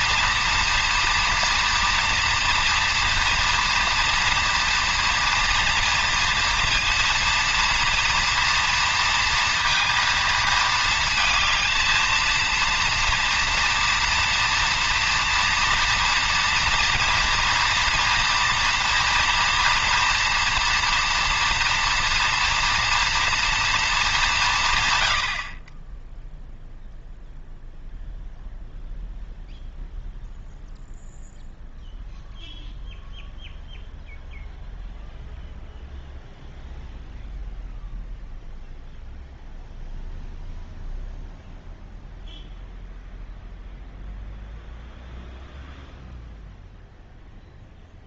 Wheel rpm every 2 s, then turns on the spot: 230, 230, 230, 230, 230, 230, 230, 240, 240, 230, 230, 230, 160, 0, 0, 0, 0, 0, 0, 0, 0, 0, 0, 0.
none